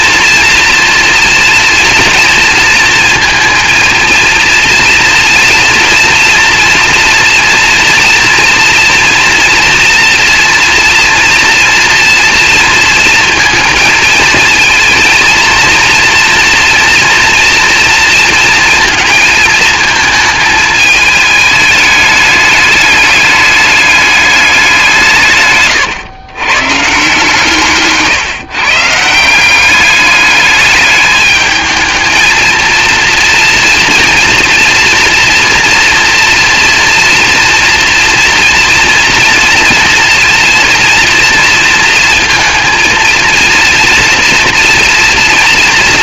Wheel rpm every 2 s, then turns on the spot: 230, 230, 230, 240, 230, 230, 230, 220, 230, 230, 220, 210, 180, 140, 150, 210, 230, 240, 230, 240, 230, 230, 230.
none